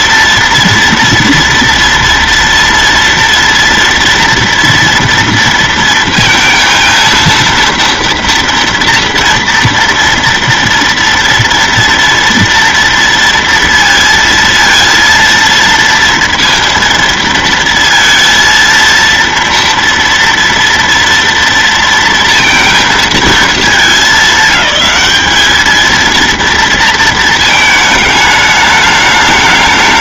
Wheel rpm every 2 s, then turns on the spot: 230, 230, 230, 230, 230, 230, 230, 230, 230, 230, 230, 230, 210, 230, 210.
none